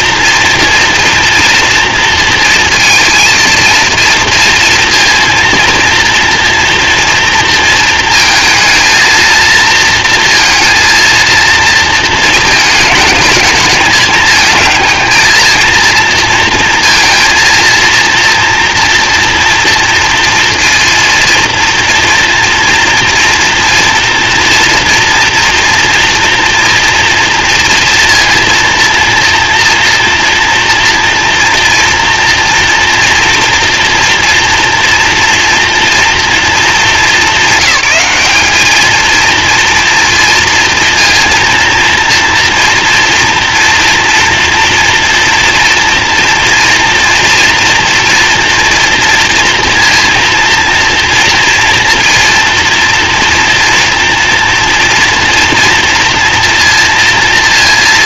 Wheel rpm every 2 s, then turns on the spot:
240, 230, 230, 240, 230, 230, 220, 220, 230, 230, 230, 240, 230, 230, 230, 230, 230, 230, 210, 220, 230, 240, 230, 230, 240, 230, 240, 230, 230.
none